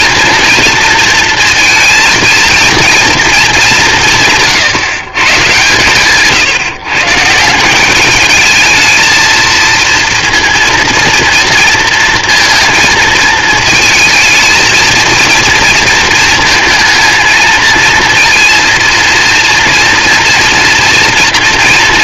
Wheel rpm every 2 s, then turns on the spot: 230, 230, 160, 140, 220, 230, 230, 230, 220, 230, 230.
none